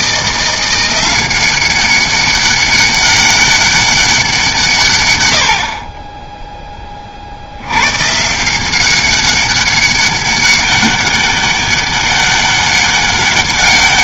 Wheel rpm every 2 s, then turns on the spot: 170, 200, 160, 10, 170, 200, 200.
none